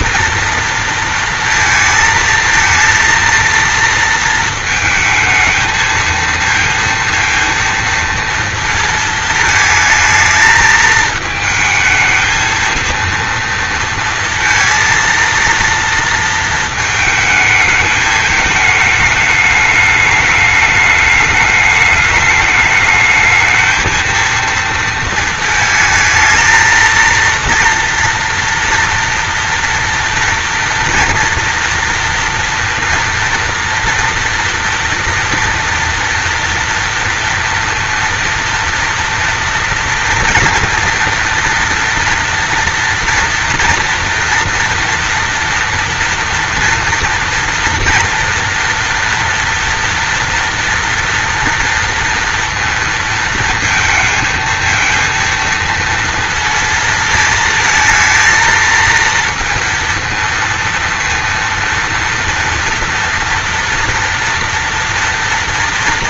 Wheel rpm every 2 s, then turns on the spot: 230, 230, 220, 230, 220, 220, 230, 230, 220, 210, 210, 210, 230, 230, 230, 230, 230, 230, 230, 230, 230, 230, 230, 230, 230, 230, 230, 230, 220, 230, 230, 230, 230.
none